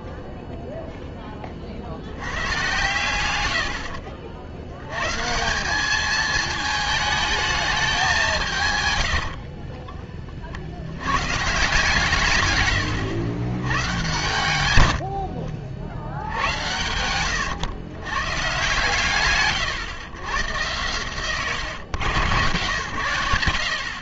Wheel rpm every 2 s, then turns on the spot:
0, 100, 80, 220, 160, 60, 120, 100, 100, 130, 120, 110.
14-16